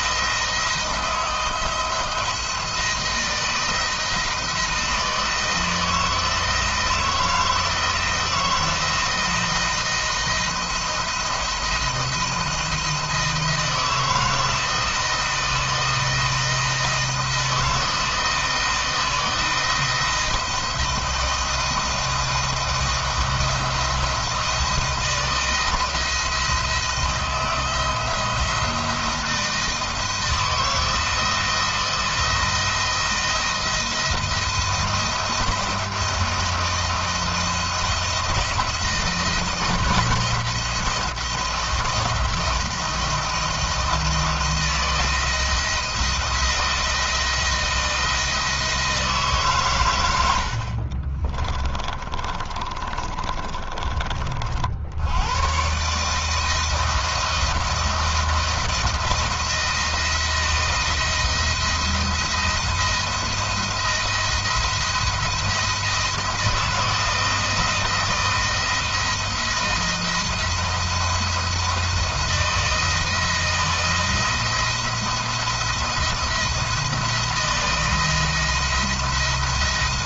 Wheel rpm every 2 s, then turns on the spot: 170, 170, 170, 160, 160, 170, 160, 160, 170, 170, 170, 170, 170, 170, 160, 170, 170, 170, 170, 170, 170, 170, 160, 170, 160, 70, 40, 50, 160, 160, 170, 170, 170, 160, 170, 170, 170, 160, 170, 170.
52-54